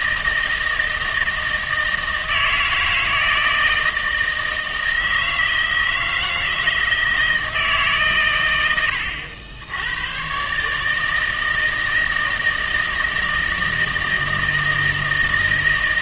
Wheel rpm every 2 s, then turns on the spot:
160, 160, 160, 160, 90, 150, 160, 160.
none